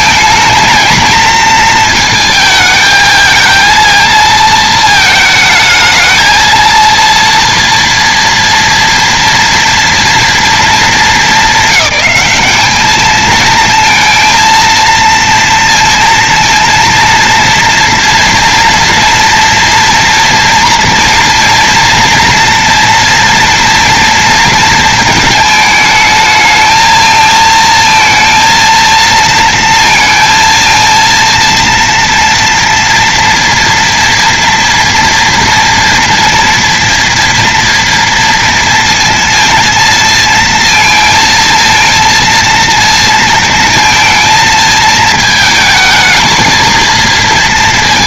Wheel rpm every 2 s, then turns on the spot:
230, 220, 220, 230, 230, 230, 210, 230, 230, 240, 230, 230, 230, 220, 230, 230, 230, 230, 230, 230, 220, 230, 220, 220.
none